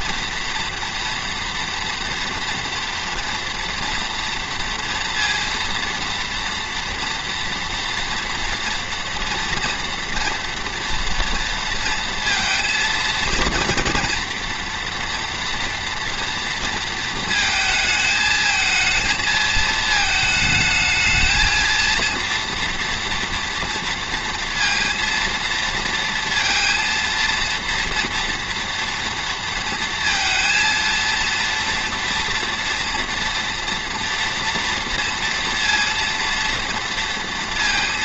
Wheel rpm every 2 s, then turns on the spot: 230, 230, 230, 230, 230, 230, 230, 240, 230, 230, 220, 230, 230, 230, 230, 230, 240, 240, 230.
none